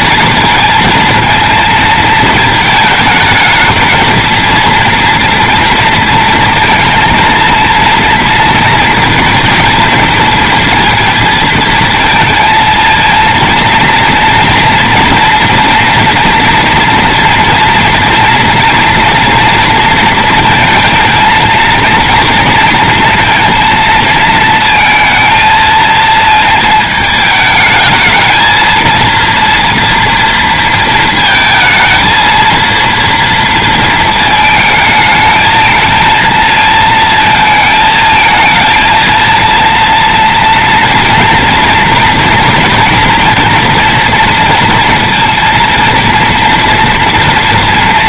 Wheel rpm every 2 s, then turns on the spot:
230, 220, 230, 230, 230, 230, 230, 230, 230, 230, 220, 230, 220, 220, 230, 220, 230, 220, 220, 230, 230, 230, 230, 230.
none